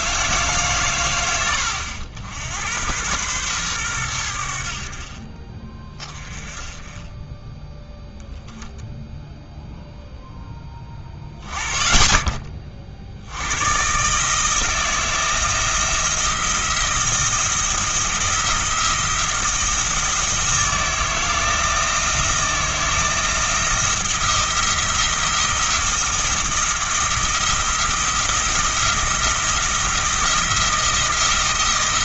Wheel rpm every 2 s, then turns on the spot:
130, 90, 60, 20, 10, 10, 40, 160, 170, 170, 170, 170, 170, 170, 170, 160.
none